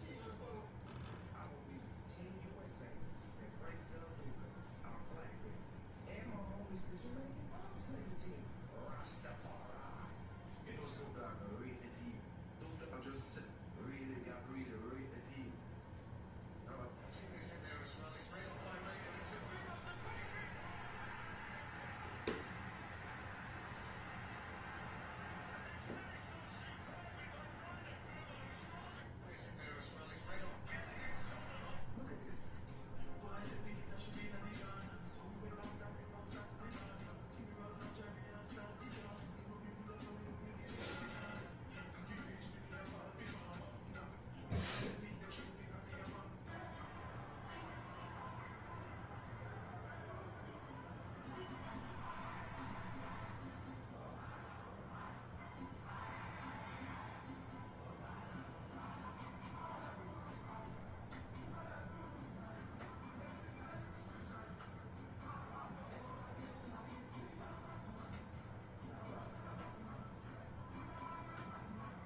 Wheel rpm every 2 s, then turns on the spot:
0, 0, 0, 0, 0, 0, 0, 0, 0, 0, 0, 0, 0, 0, 0, 0, 0, 0, 0, 0, 0, 0, 0, 0, 0, 0, 0, 0, 0, 0, 0, 0, 0, 0, 0, 0.
none